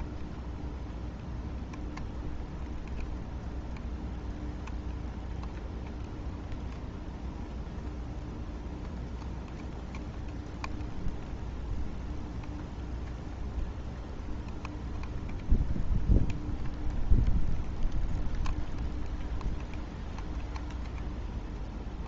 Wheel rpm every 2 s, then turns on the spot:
0, 0, 0, 0, 0, 0, 0, 0, 0, 0, 0.
none